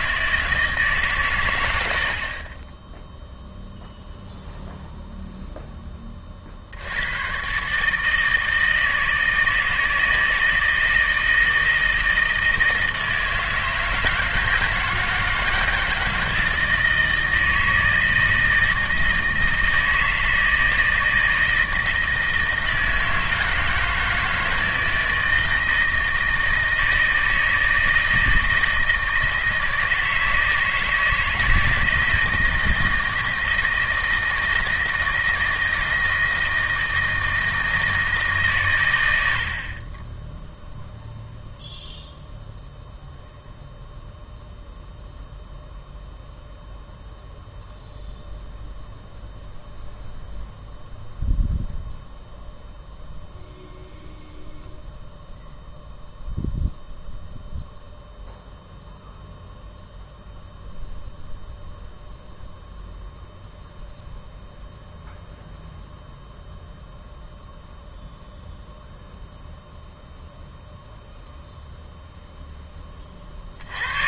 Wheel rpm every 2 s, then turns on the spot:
150, 20, 0, 60, 160, 160, 160, 160, 160, 160, 160, 160, 160, 160, 160, 160, 160, 160, 160, 120, 0, 0, 0, 0, 0, 0, 0, 0, 0, 0, 0, 0, 0, 0, 0, 0, 10.
none